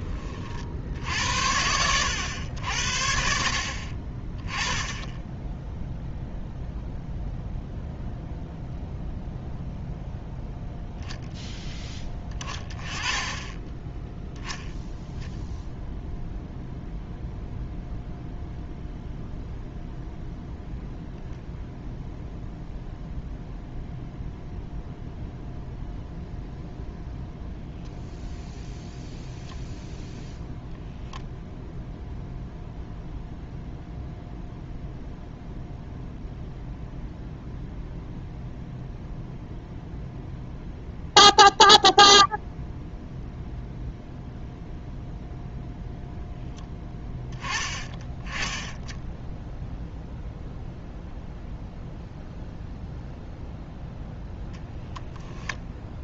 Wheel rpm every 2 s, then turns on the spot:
70, 70, 10, 0, 0, 0, 10, 0, 0, 0, 0, 0, 0, 0, 0, 0, 0, 0, 0, 0, 0, 0, 0, 10, 10, 0, 0, 0.
none